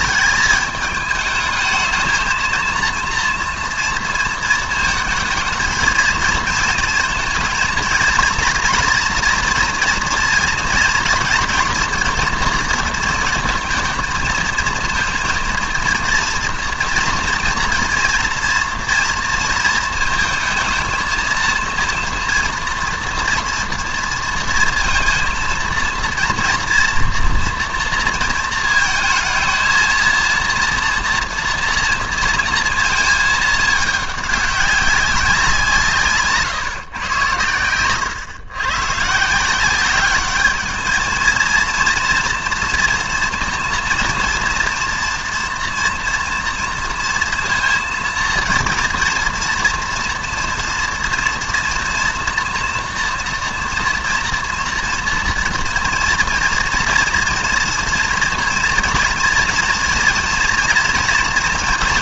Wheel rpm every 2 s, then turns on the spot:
210, 230, 230, 230, 230, 230, 230, 230, 230, 230, 220, 230, 230, 230, 230, 230, 230, 200, 140, 120, 220, 230, 230, 230, 230, 230, 230, 230, 230, 230, 230.
none